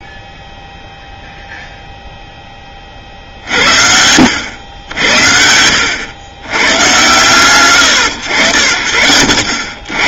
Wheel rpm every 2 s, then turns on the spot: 0, 40, 80, 110, 70.
none